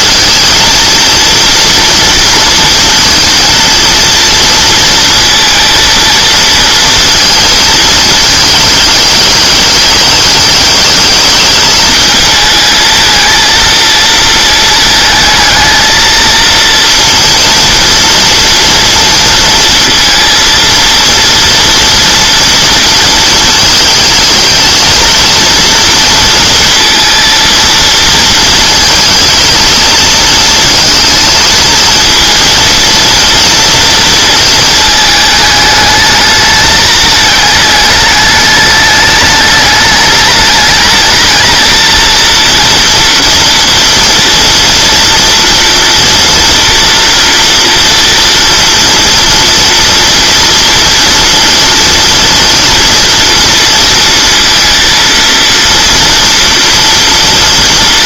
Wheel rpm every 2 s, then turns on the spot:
230, 230, 230, 230, 220, 210, 220, 220, 230, 230, 230, 230, 220, 230, 220, 220, 230, 220, 210, 210, 220, 230, 230, 230, 230, 230, 230, 230, 230.
none